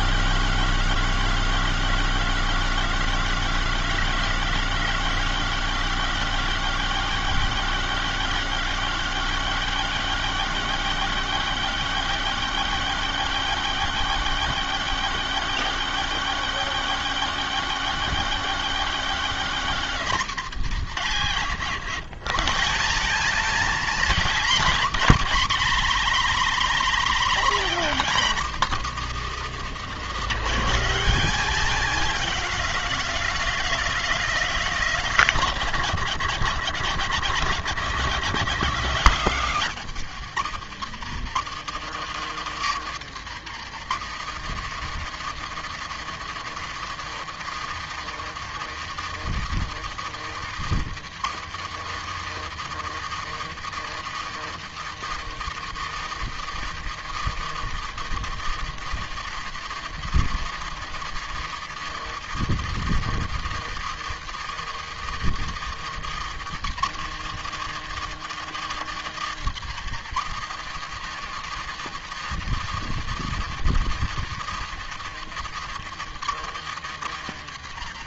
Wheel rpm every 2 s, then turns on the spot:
100, 100, 100, 100, 100, 100, 100, 100, 100, 110, 100, 200, 140, 130, 160, 190, 190, 140, 80, 90, 140, 150, 160, 160, 170, 160, 160, 170, 170, 170, 170, 170, 160, 160, 150, 160, 170, 160, 140.
none